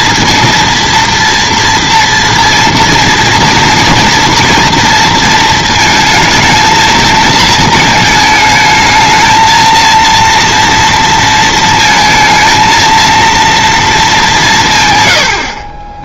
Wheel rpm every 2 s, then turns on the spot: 240, 240, 240, 220, 220, 230, 230, 160.
none